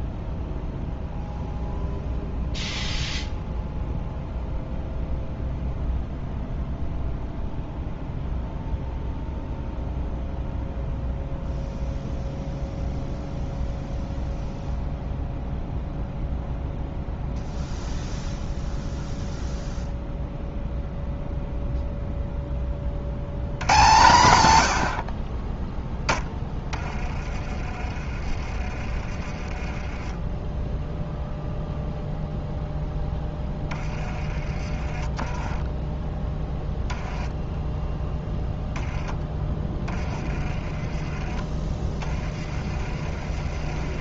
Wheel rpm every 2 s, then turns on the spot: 0, 0, 0, 0, 0, 0, 0, 0, 0, 0, 0, 30, 80, 20, 30, 10, 0, 20, 10, 10, 20, 30.
none